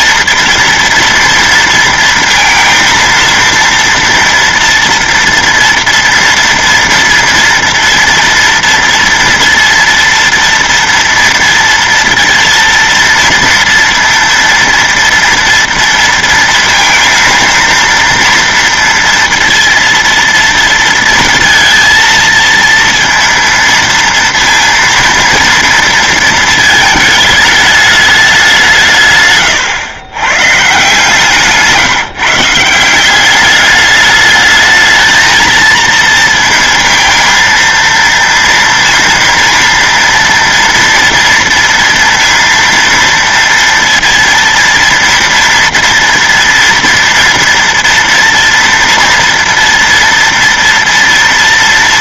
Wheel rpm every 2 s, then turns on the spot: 230, 230, 230, 230, 230, 230, 230, 230, 230, 230, 230, 230, 230, 220, 190, 130, 160, 210, 230, 230, 230, 230, 240, 230, 230, 230.
none